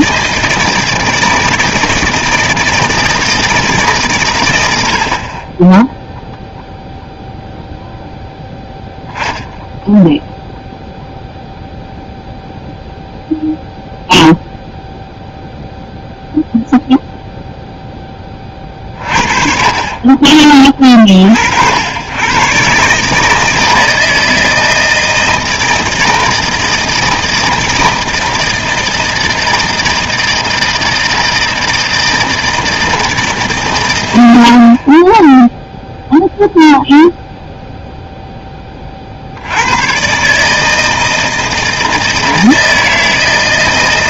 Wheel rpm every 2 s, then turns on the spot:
160, 160, 100, 0, 0, 0, 0, 0, 0, 40, 40, 130, 160, 160, 160, 160, 160, 50, 0, 20, 160, 160.
none